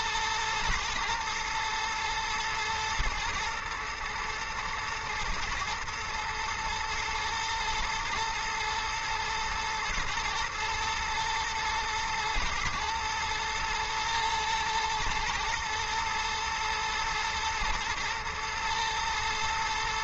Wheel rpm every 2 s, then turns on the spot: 120, 110, 120, 110, 110, 120, 110, 110, 120, 110.
none